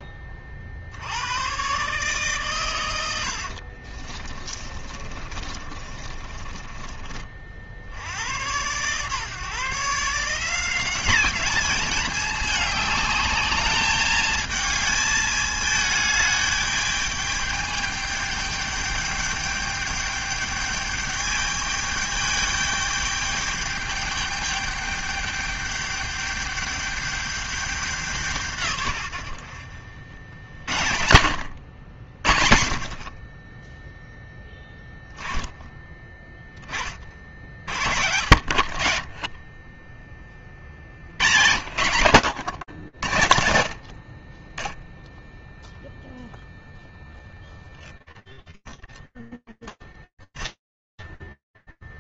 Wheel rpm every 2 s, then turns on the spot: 20, 130, 40, 30, 90, 160, 210, 220, 210, 210, 210, 210, 210, 210, 170, 70, 50, 0, 10, 60, 30, 110, 40, 0, 0, 0.
4-8